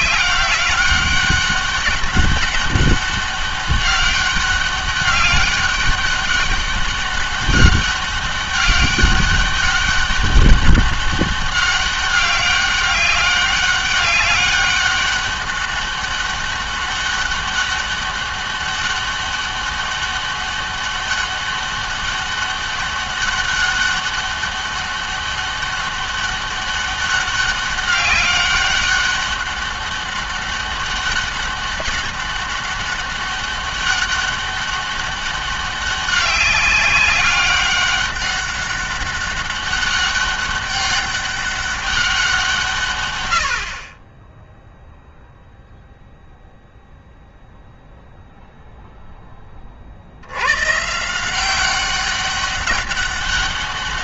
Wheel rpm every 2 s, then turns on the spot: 190, 200, 200, 200, 200, 200, 200, 200, 200, 200, 200, 200, 200, 200, 200, 200, 200, 200, 200, 200, 200, 150, 0, 0, 0, 130, 200.
none